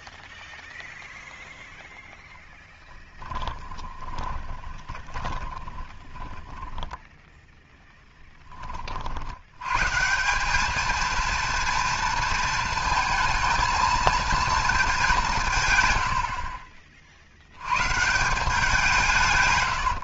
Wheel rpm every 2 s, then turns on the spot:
0, 10, 20, 10, 30, 210, 230, 220, 50, 180.
4-8